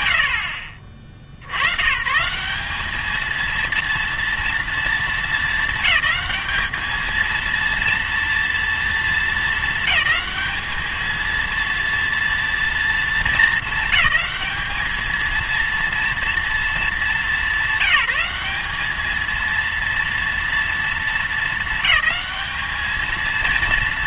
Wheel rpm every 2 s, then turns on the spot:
90, 200, 220, 210, 230, 220, 230, 220, 230, 210, 230, 220.
none